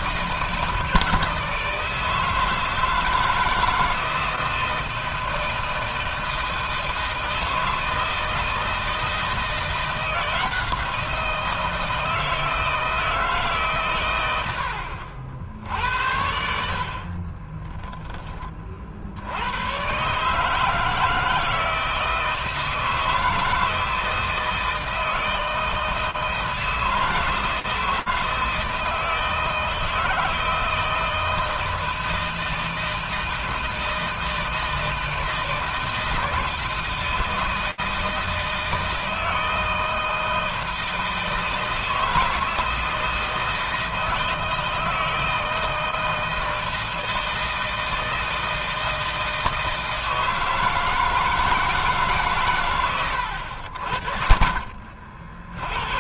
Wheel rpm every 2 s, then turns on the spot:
160, 160, 160, 160, 160, 170, 160, 70, 50, 40, 160, 160, 160, 160, 160, 170, 160, 160, 160, 160, 160, 160, 160, 160, 160, 160, 100, 60.
none